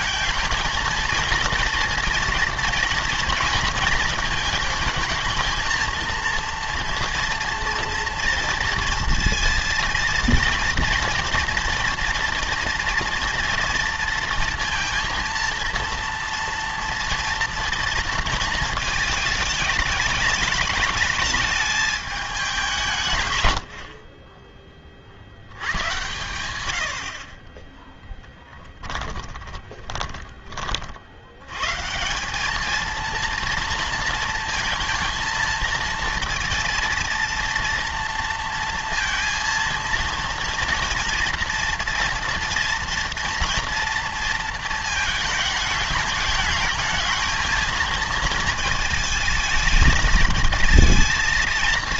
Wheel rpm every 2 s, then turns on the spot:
220, 240, 220, 230, 230, 230, 230, 230, 240, 230, 210, 190, 20, 110, 20, 40, 220, 230, 230, 230, 230, 230, 220, 220, 220, 220.
28-30